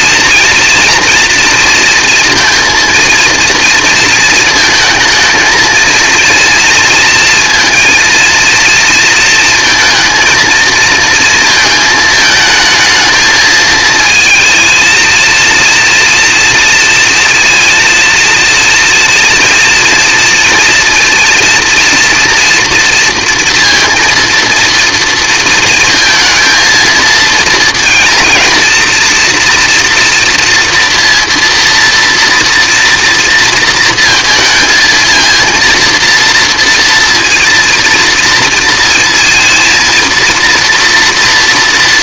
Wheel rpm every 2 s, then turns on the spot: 240, 230, 230, 230, 230, 230, 220, 230, 230, 230, 230, 230, 230, 230, 230, 230, 230, 220, 230, 230, 240.
none